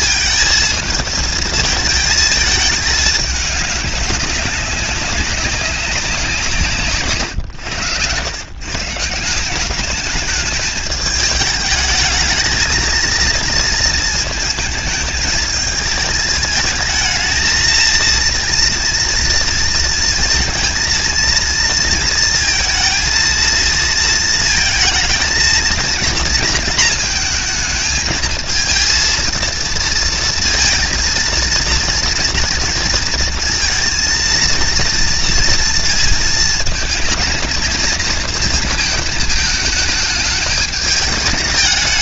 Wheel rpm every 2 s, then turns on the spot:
220, 210, 190, 140, 160, 210, 230, 220, 220, 230, 230, 230, 220, 230, 230, 230, 230, 230, 230, 220, 210.
none